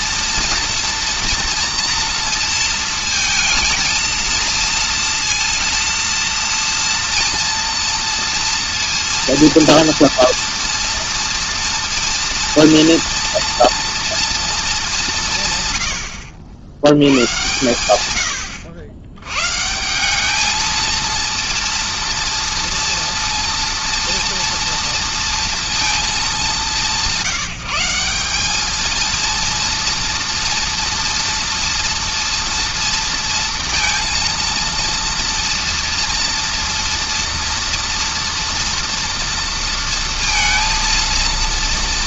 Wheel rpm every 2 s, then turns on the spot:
230, 230, 230, 230, 230, 230, 230, 210, 100, 90, 220, 230, 230, 190, 220, 230, 230, 230, 230, 230, 230.
none